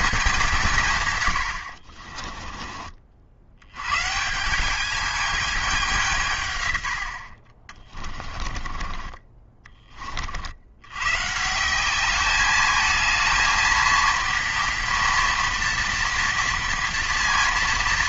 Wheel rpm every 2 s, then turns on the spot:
170, 30, 190, 120, 30, 70, 210, 230, 230.
8-10